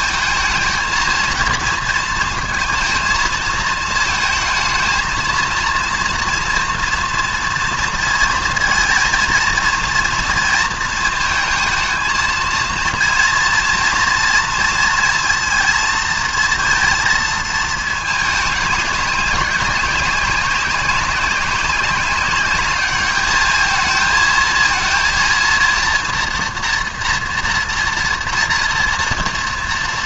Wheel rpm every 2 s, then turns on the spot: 230, 220, 220, 230, 230, 230, 230, 230, 230, 200, 190, 210, 230, 240, 240.
none